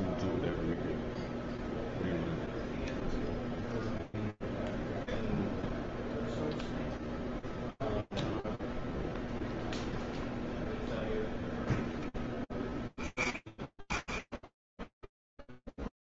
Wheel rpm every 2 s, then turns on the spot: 0, 0, 0, 0, 0, 0, 10, 20.
none